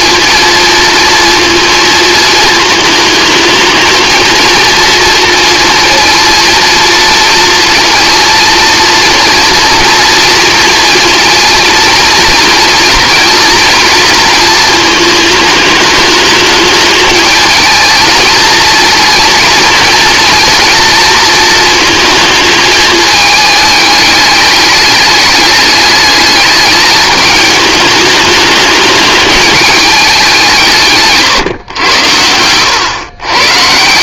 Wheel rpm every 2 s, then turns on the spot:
230, 220, 230, 230, 230, 240, 230, 220, 210, 230, 230, 220, 210, 210, 210, 170, 100.
none